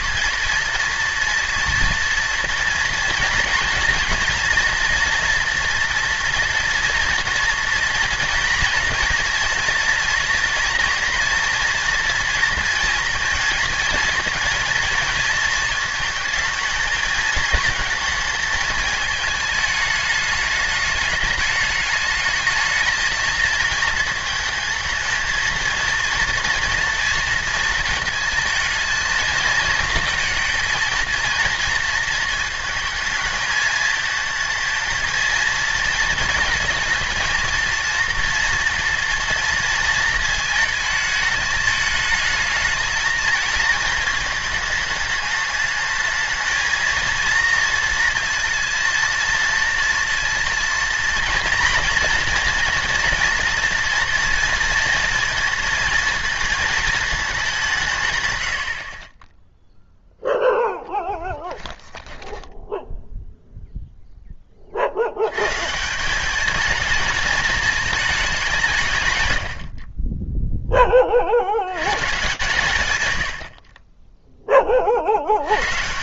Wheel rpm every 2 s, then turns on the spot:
230, 230, 240, 230, 230, 240, 230, 230, 220, 220, 210, 220, 220, 230, 230, 230, 220, 220, 220, 240, 220, 220, 210, 230, 230, 230, 230, 230, 220, 60, 10, 0, 50, 220, 130, 20, 130, 30.
60-62